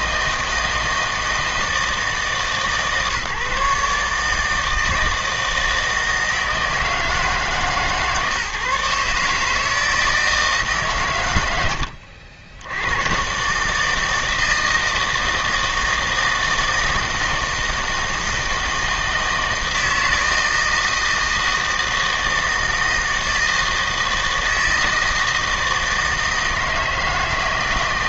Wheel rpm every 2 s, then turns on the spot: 160, 150, 160, 160, 140, 150, 90, 160, 160, 160, 160, 160, 160, 160.
none